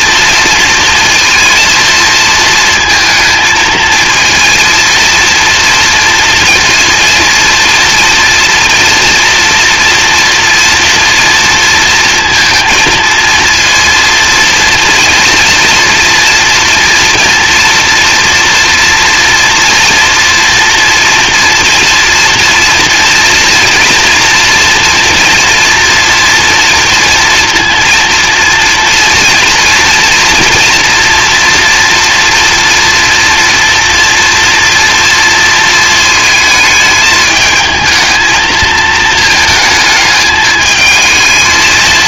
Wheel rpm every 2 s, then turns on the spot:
230, 230, 230, 230, 230, 230, 230, 230, 230, 240, 230, 230, 240, 230, 230, 230, 230, 230, 220, 220, 220.
none